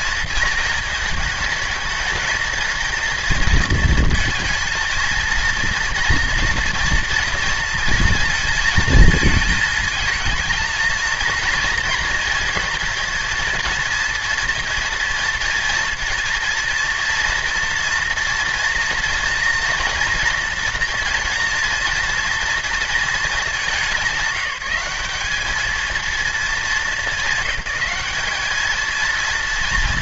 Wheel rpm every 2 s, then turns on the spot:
220, 230, 230, 230, 220, 220, 230, 230, 230, 240, 240, 210, 200, 200, 230.
none